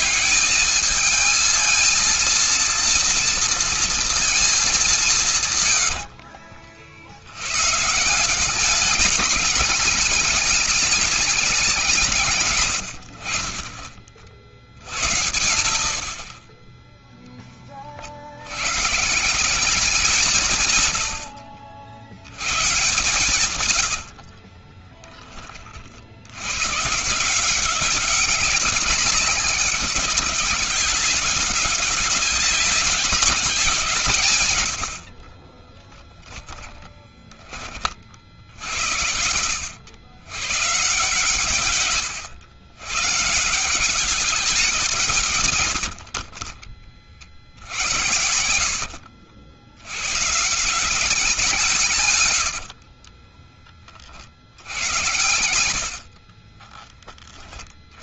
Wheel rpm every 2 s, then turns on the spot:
220, 240, 160, 80, 210, 210, 50, 80, 10, 170, 110, 140, 10, 130, 190, 190, 200, 80, 10, 70, 140, 130, 160, 20, 70, 170, 80, 90, 30.
4-6 22-24 34-38 52-54 56-58